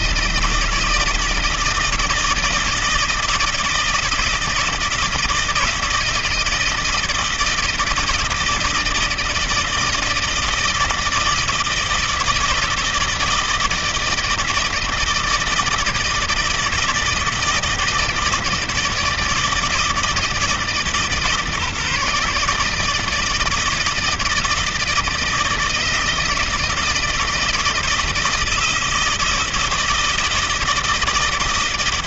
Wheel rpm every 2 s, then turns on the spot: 160, 160, 160, 160, 160, 160, 160, 160, 160, 160, 160, 150, 160, 160, 160, 160.
none